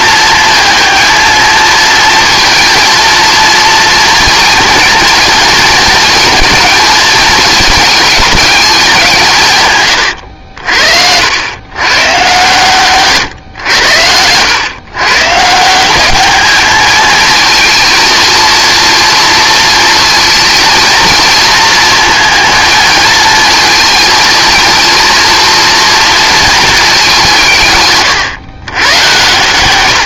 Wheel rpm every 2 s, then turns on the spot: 230, 230, 230, 220, 190, 70, 120, 120, 220, 230, 230, 220, 230, 220, 120.
none